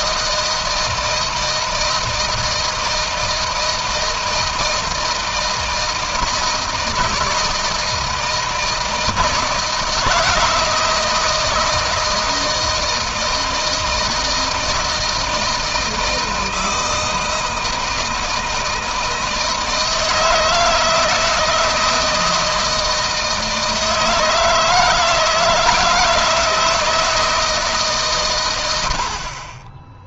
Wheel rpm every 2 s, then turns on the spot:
160, 160, 160, 160, 160, 160, 160, 160, 160, 160, 160, 160, 170, 160, 80.
none